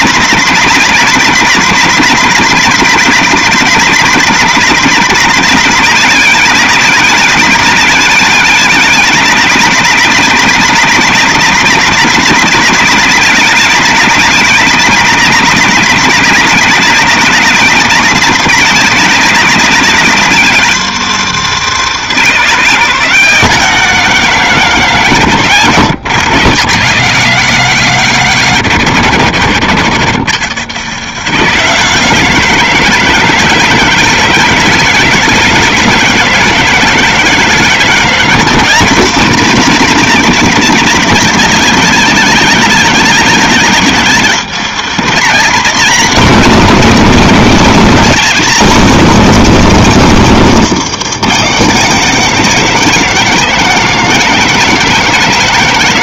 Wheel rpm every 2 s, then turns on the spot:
180, 180, 180, 170, 170, 180, 180, 170, 170, 170, 210, 190, 140, 100, 80, 110, 160, 160, 160, 170, 170, 160, 210, 180, 180, 200, 160, 160.
none